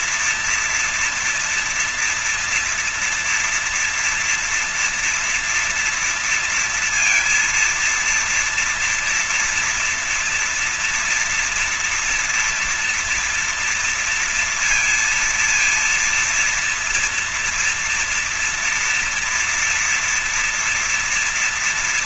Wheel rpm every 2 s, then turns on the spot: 220, 230, 230, 230, 230, 240, 240, 230, 230, 230, 230.
none